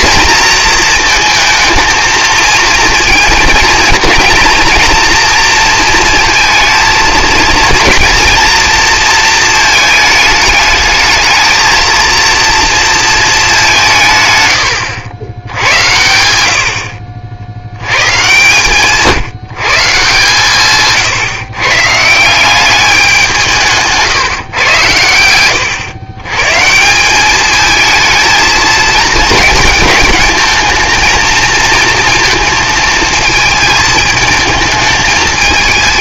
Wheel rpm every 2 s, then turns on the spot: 220, 230, 230, 220, 230, 220, 230, 80, 40, 150, 140, 190, 110, 180, 220, 220, 220, 210.
none